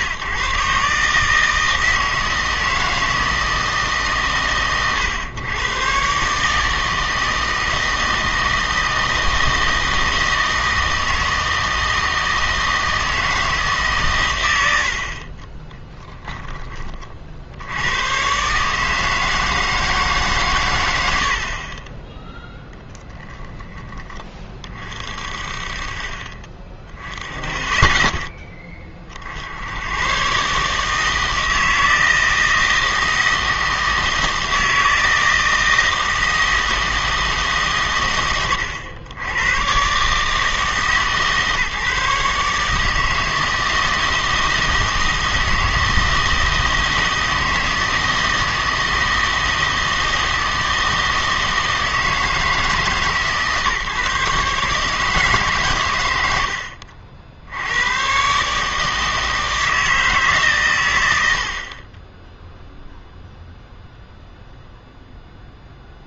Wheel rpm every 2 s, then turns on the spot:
140, 160, 120, 150, 160, 160, 160, 90, 20, 140, 120, 0, 30, 20, 30, 140, 160, 160, 160, 90, 150, 150, 160, 160, 160, 160, 160, 150, 70, 150, 120, 0, 0.
none